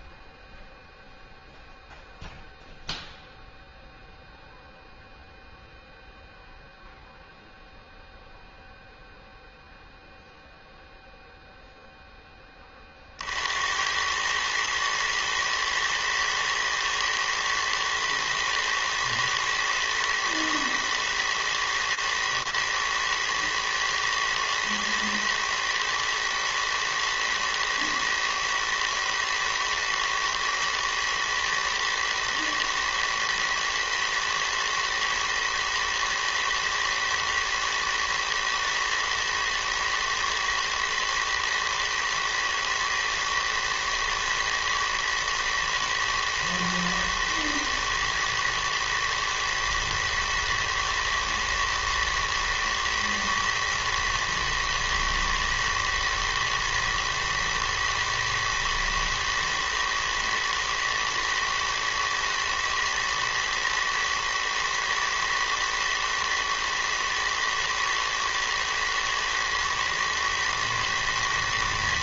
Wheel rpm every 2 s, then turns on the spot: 0, 0, 0, 0, 0, 0, 60, 110, 110, 110, 110, 120, 110, 110, 110, 110, 110, 110, 110, 110, 110, 110, 110, 110, 110, 110, 110, 110, 110, 110, 110, 120, 120, 110, 110, 110.
none